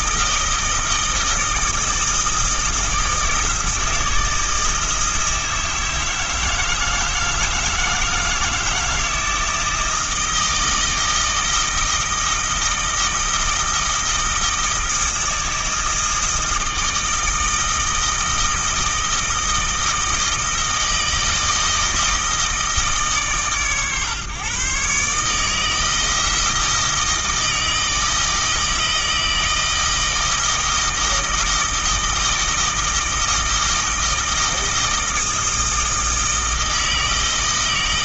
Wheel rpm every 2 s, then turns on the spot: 160, 160, 160, 160, 160, 160, 160, 160, 160, 160, 160, 160, 130, 160, 160, 160, 160, 160, 160.
none